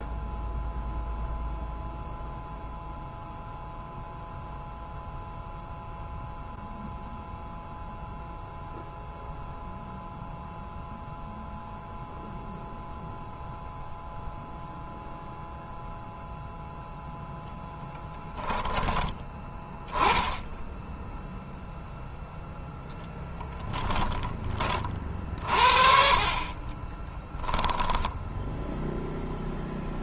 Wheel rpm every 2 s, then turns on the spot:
0, 0, 0, 0, 0, 0, 0, 0, 0, 10, 0, 10, 40, 30, 0.
22-24 26-28